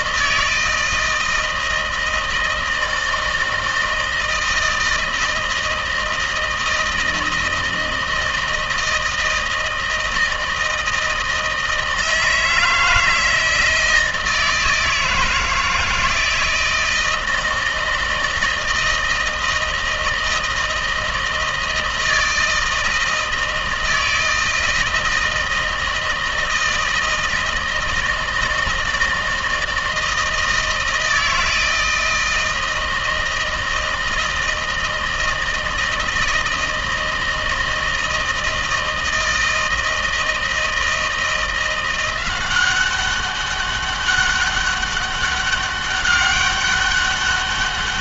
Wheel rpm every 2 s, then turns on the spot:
160, 160, 160, 170, 160, 160, 160, 160, 160, 160, 160, 160, 160, 160, 160, 160, 160, 160, 160, 160, 160, 190, 200, 200.
none